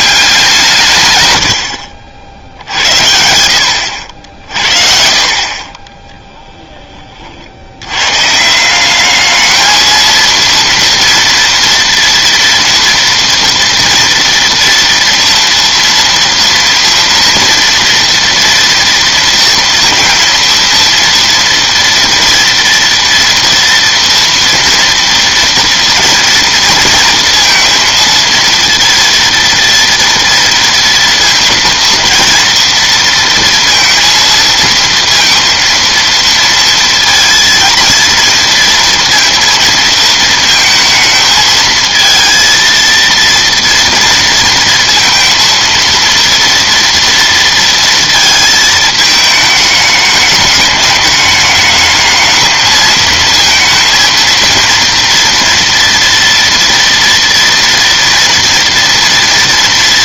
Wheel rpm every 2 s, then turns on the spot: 180, 80, 60, 10, 170, 230, 230, 240, 230, 230, 230, 230, 230, 230, 230, 230, 230, 230, 230, 230, 220, 230, 230, 230, 220, 210, 220, 230, 230, 230.
none